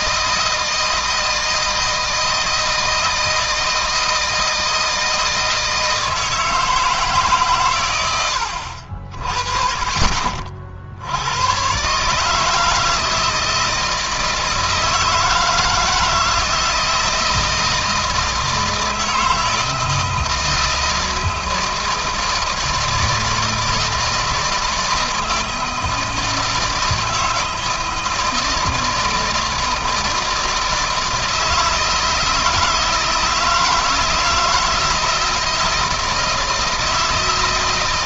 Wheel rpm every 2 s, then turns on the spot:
160, 160, 160, 150, 60, 70, 160, 160, 160, 160, 160, 160, 160, 160, 160, 160, 160, 160, 160.
none